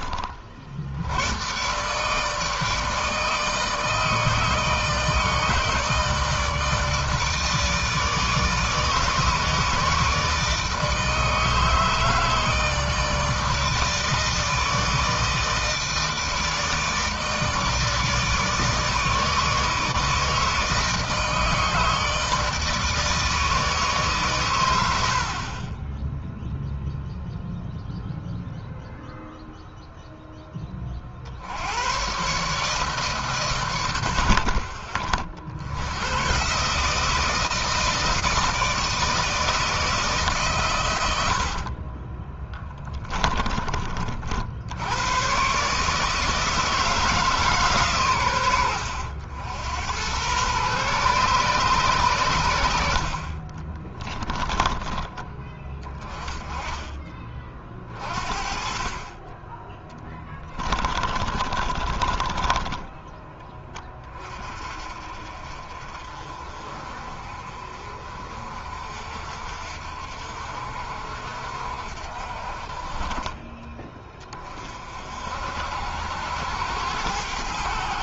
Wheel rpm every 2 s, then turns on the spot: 70, 160, 160, 160, 160, 150, 160, 160, 160, 160, 160, 160, 80, 0, 0, 30, 150, 60, 150, 160, 100, 10, 90, 160, 90, 130, 70, 10, 20, 30, 30, 20, 40, 40, 50, 60, 30, 50, 90.
40-42 52-54 60-64